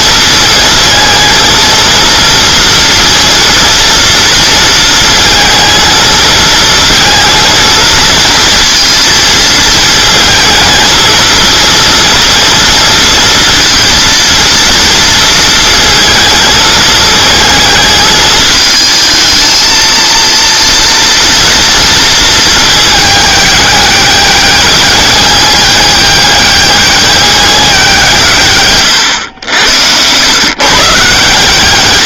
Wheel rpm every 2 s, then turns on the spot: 220, 230, 230, 230, 220, 220, 230, 230, 220, 220, 230, 220, 200, 200, 120, 140.
none